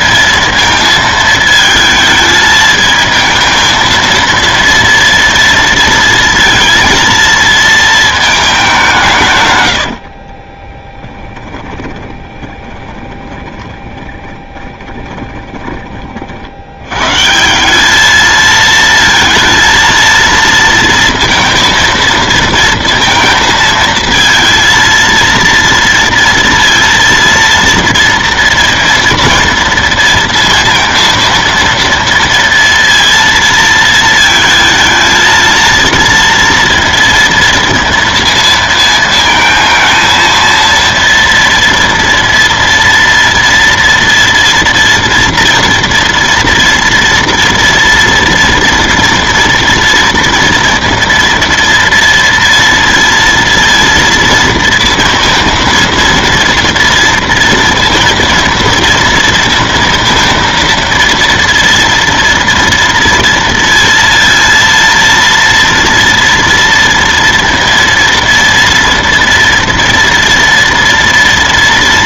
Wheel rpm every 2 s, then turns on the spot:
230, 220, 230, 230, 200, 30, 20, 30, 70, 220, 230, 230, 230, 230, 230, 230, 230, 220, 230, 230, 230, 230, 230, 230, 230, 230, 230, 230, 230, 230, 230, 230, 230, 230, 230, 230.
10-16